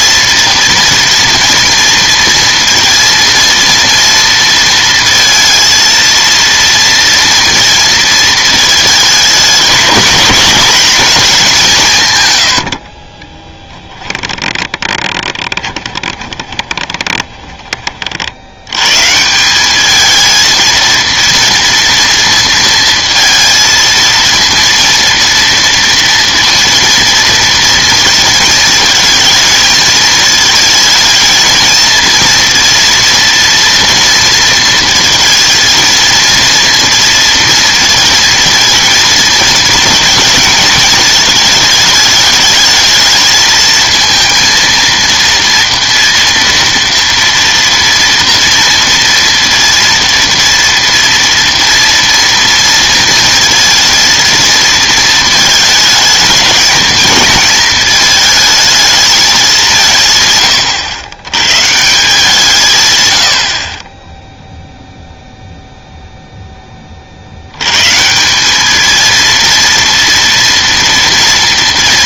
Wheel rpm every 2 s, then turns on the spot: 230, 230, 230, 230, 220, 230, 80, 10, 20, 100, 220, 230, 230, 230, 220, 220, 230, 230, 230, 230, 220, 210, 230, 230, 230, 230, 230, 230, 220, 220, 110, 140, 0, 20, 200, 230.
12-18